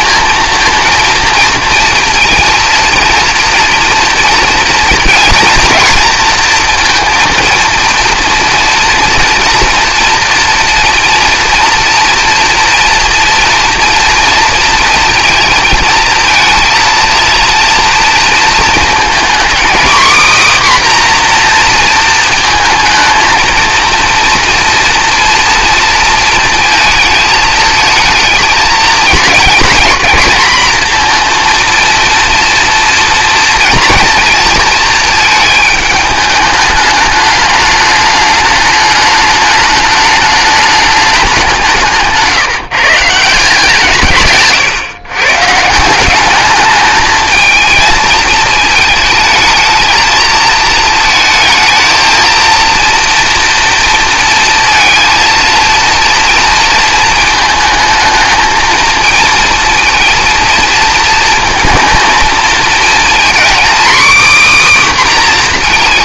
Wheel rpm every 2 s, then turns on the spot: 230, 230, 230, 230, 240, 230, 230, 230, 230, 230, 270, 230, 240, 220, 220, 230, 230, 230, 210, 210, 210, 150, 140, 210, 220, 220, 230, 230, 230, 230, 230, 230, 270.
none